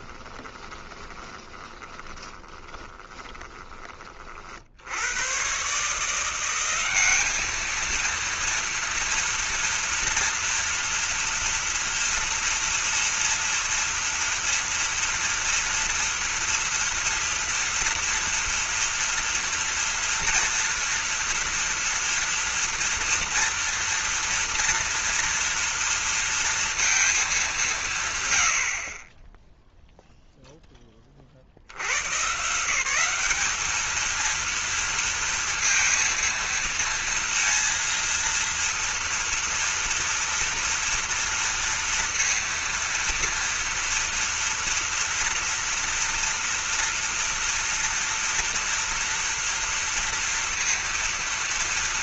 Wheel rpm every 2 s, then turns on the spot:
20, 20, 50, 190, 230, 230, 230, 230, 230, 230, 230, 230, 230, 230, 80, 10, 180, 230, 230, 230, 230, 230, 230, 230, 230, 230.
0-4